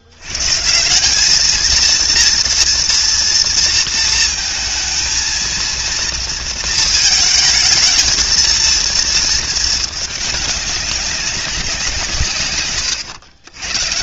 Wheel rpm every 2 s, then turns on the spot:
80, 230, 230, 230, 230, 200, 120.
none